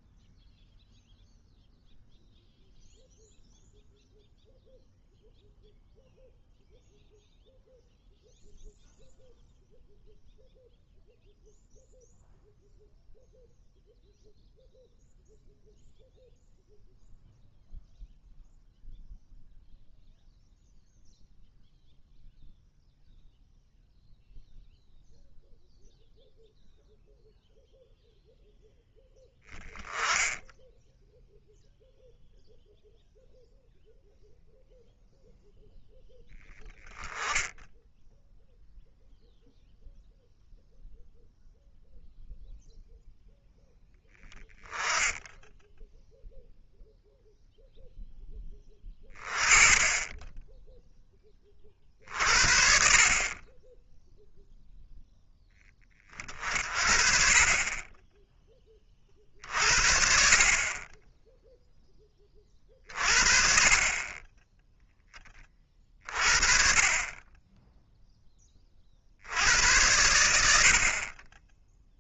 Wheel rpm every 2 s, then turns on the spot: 0, 0, 0, 0, 0, 0, 0, 0, 0, 0, 0, 0, 0, 0, 10, 0, 0, 0, 10, 0, 0, 0, 10, 0, 20, 10, 40, 0, 40, 30, 40, 40, 10, 30, 30, 70.
none